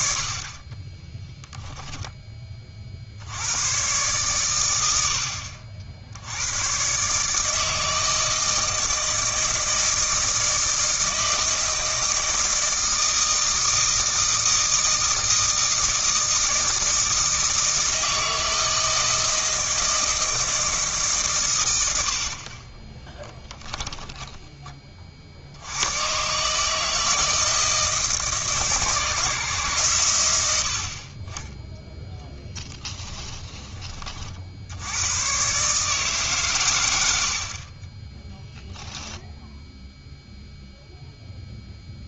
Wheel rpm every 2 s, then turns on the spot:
20, 40, 100, 110, 160, 160, 160, 160, 160, 160, 160, 30, 30, 150, 160, 70, 10, 80, 110, 10, 0.
0-2 32-34